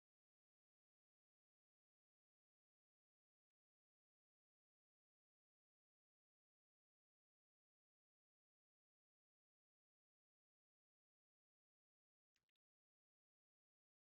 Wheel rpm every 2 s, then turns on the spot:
0, 0, 0, 0, 0, 0, 0.
none